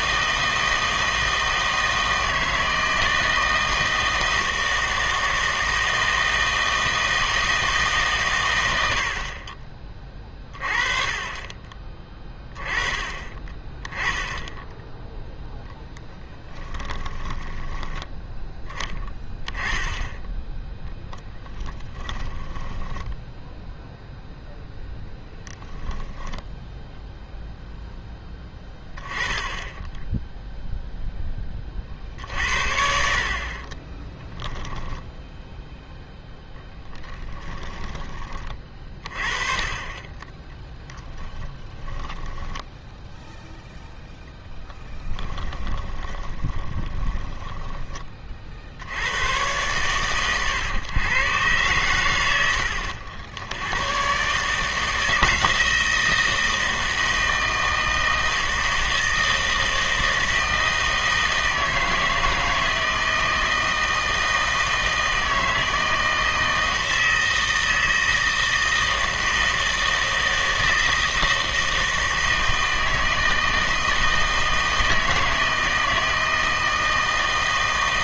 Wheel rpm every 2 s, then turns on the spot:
160, 160, 160, 160, 100, 30, 20, 10, 10, 10, 10, 20, 0, 0, 10, 0, 70, 10, 0, 30, 10, 10, 10, 20, 50, 120, 80, 150, 160, 160, 160, 160, 160, 160, 160, 160, 160, 160, 160.
16-18 22-24 34-36 40-42 44-48